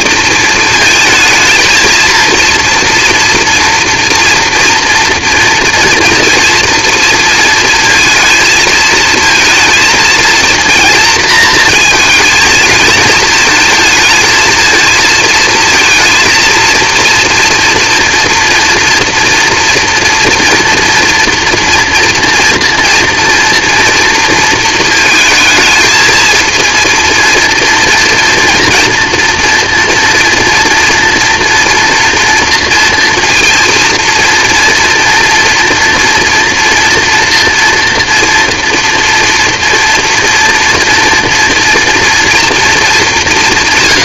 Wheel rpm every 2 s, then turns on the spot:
230, 230, 230, 230, 220, 230, 220, 230, 230, 230, 230, 230, 220, 230, 230, 230, 230, 230, 230, 240, 230, 230.
none